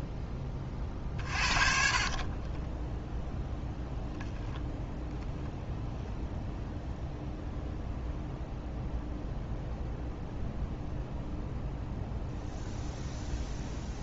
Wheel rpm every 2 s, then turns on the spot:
30, 10, 10, 0, 0, 0, 0.
0-4